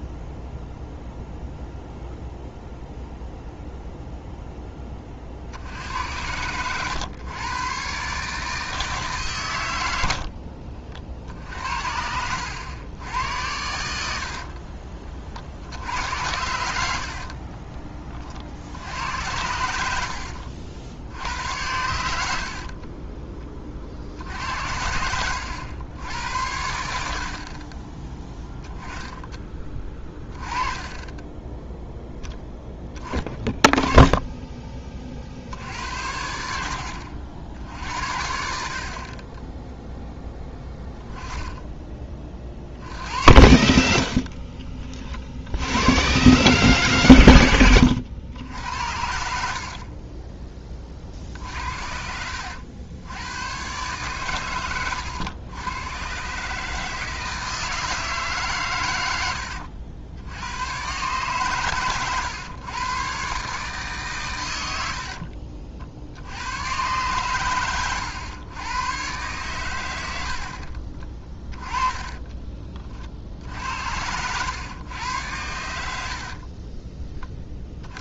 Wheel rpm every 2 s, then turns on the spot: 0, 0, 10, 110, 160, 60, 90, 40, 70, 60, 70, 60, 70, 80, 10, 20, 10, 20, 70, 50, 10, 50, 40, 130, 80, 20, 80, 110, 150, 130, 100, 120, 90, 100, 110, 50, 30, 100, 30.
10-12 14-16 22-24 44-46 70-72 76-78